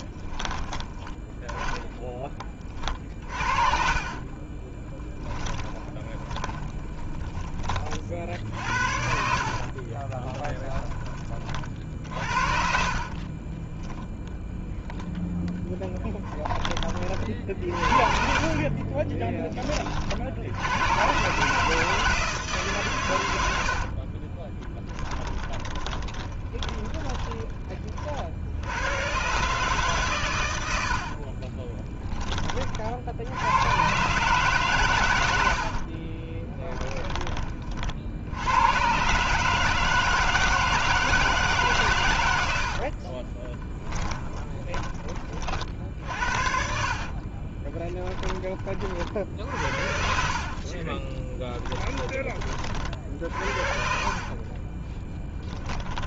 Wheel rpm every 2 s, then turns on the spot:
10, 40, 10, 20, 60, 20, 40, 0, 30, 30, 100, 130, 20, 20, 80, 70, 60, 120, 10, 110, 160, 60, 20, 50, 40, 30, 50, 20.
2-10 12-14 18-20 24-28 42-44 46-48 50-56